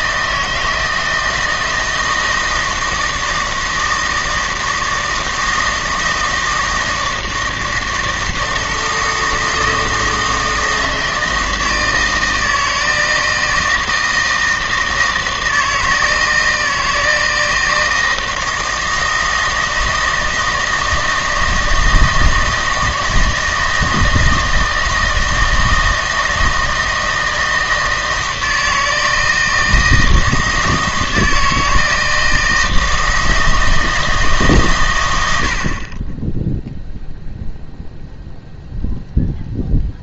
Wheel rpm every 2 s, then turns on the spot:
160, 160, 160, 160, 160, 160, 160, 160, 160, 160, 160, 160, 160, 160, 160, 160, 160, 140, 0, 0.
none